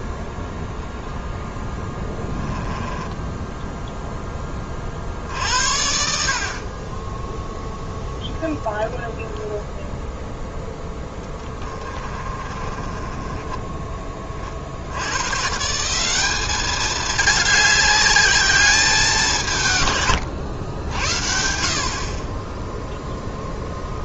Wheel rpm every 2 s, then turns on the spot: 0, 10, 30, 40, 10, 10, 30, 60, 210, 200, 80, 0.
2-4 10-14